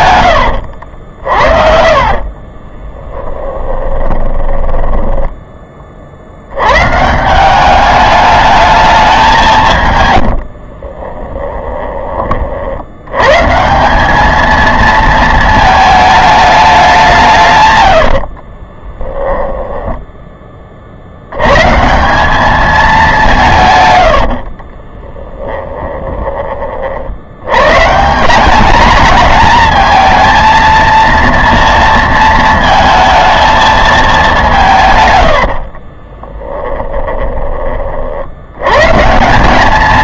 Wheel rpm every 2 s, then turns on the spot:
80, 30, 10, 110, 210, 40, 50, 220, 200, 20, 40, 210, 40, 40, 210, 230, 220, 160, 20, 120.
0-6 10-12 18-20 24-26 36-38